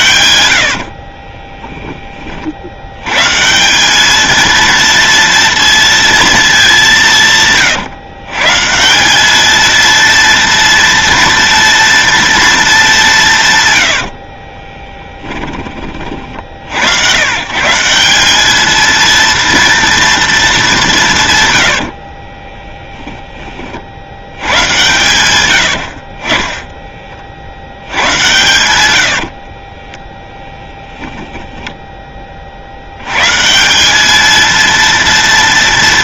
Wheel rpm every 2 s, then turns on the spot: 80, 90, 230, 200, 160, 230, 210, 20, 70, 220, 200, 20, 110, 10, 110, 10, 70, 220.
0-2 14-16 22-24 28-30